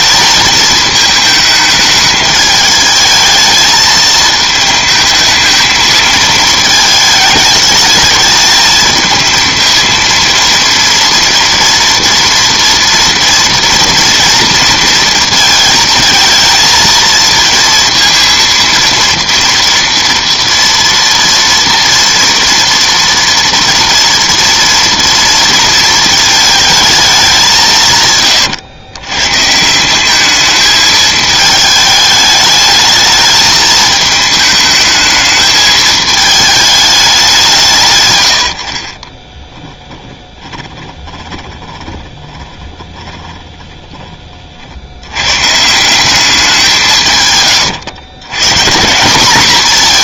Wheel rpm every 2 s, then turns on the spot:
220, 210, 220, 220, 220, 230, 230, 230, 230, 230, 230, 230, 230, 220, 110, 220, 210, 220, 210, 60, 20, 20, 80, 180, 180.
38-44